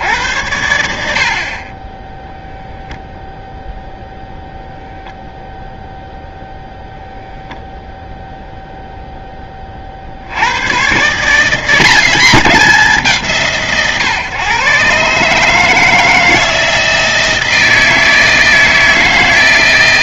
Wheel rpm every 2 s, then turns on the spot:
50, 0, 0, 0, 10, 140, 150, 150, 160, 160.
none